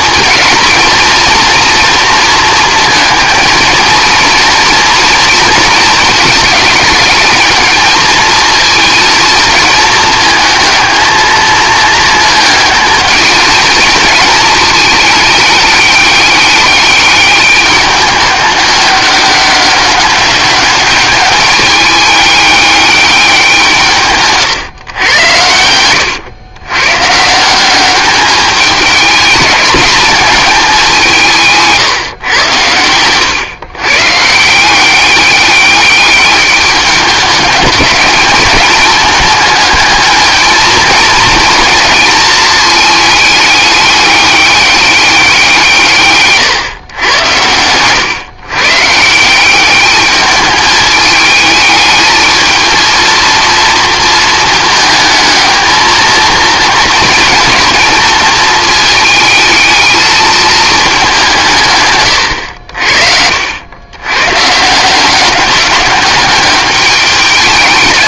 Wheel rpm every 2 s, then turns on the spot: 220, 220, 230, 210, 220, 220, 220, 220, 200, 200, 200, 210, 140, 110, 210, 210, 110, 170, 200, 210, 220, 220, 200, 130, 140, 210, 230, 220, 230, 220, 210, 80, 150, 210.
none